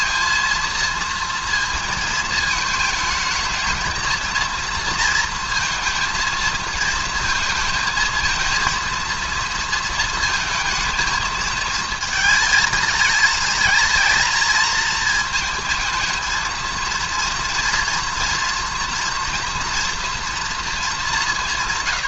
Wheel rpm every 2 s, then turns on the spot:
230, 220, 230, 220, 230, 220, 230, 230, 220, 240, 240.
none